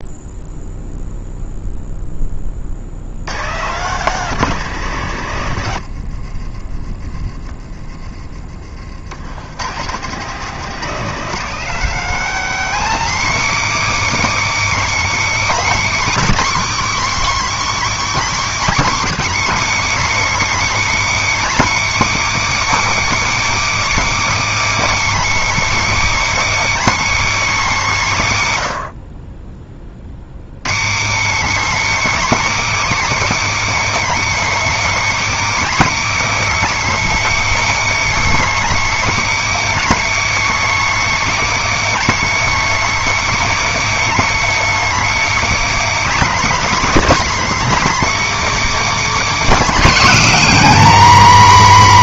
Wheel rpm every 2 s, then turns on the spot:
0, 50, 180, 40, 60, 180, 260, 320, 310, 310, 320, 330, 320, 320, 130, 200, 320, 320, 320, 320, 320, 320, 320, 310, 320, 270.
6-8